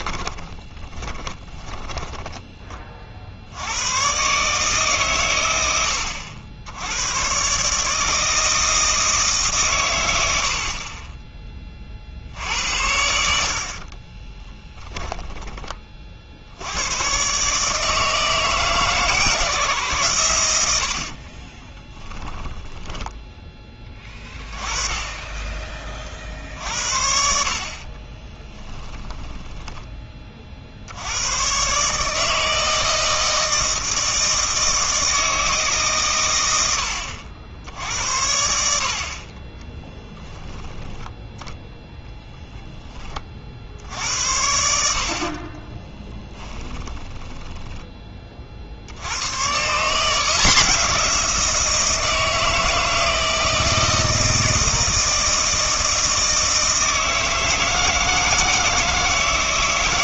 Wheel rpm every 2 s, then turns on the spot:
20, 20, 140, 80, 160, 70, 70, 10, 80, 160, 90, 10, 20, 60, 10, 50, 160, 160, 90, 70, 10, 10, 70, 20, 50, 170, 160, 160, 160, 160.
0-2 14-16 22-24 28-30 46-48